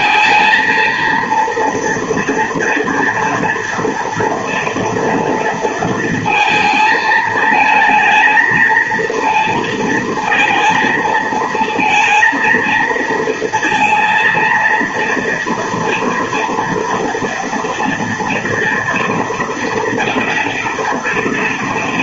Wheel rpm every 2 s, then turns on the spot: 230, 230, 230, 230, 220, 230, 230, 230, 240, 240, 240.
none